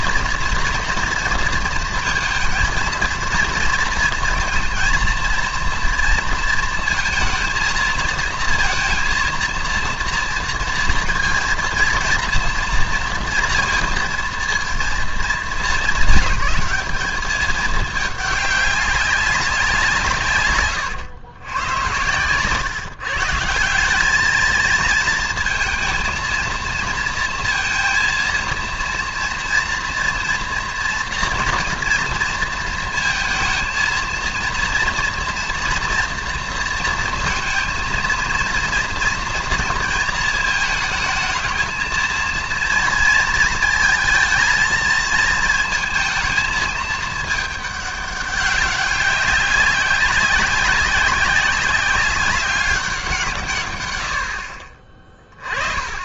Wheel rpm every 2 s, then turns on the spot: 230, 230, 230, 230, 230, 230, 230, 220, 200, 200, 120, 140, 220, 230, 230, 230, 230, 230, 230, 230, 220, 230, 220, 220, 200, 190, 190, 50.
20-22